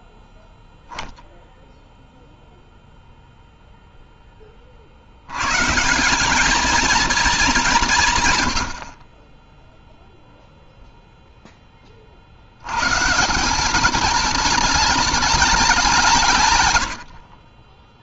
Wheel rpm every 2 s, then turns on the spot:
0, 0, 170, 170, 0, 20, 180, 190, 30.
none